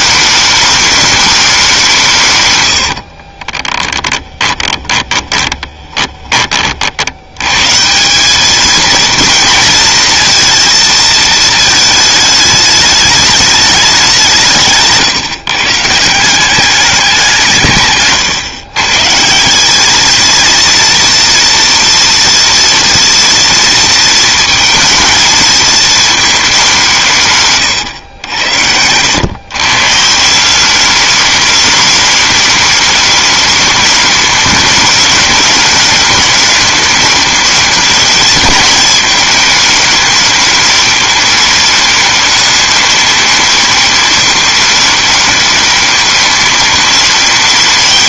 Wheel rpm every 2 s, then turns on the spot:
210, 110, 20, 40, 210, 230, 210, 160, 190, 130, 230, 230, 230, 200, 90, 190, 210, 210, 210, 220, 210, 210, 210, 210.
2-6